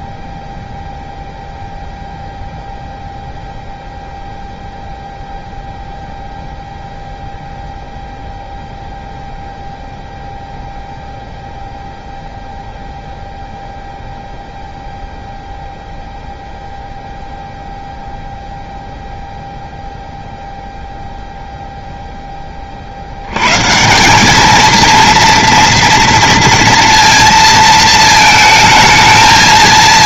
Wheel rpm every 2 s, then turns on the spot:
0, 0, 0, 0, 0, 0, 0, 0, 0, 0, 0, 40, 220, 230, 220.
none